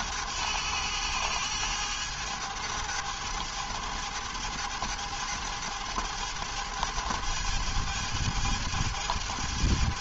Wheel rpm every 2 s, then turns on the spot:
110, 110, 110, 110, 110.
none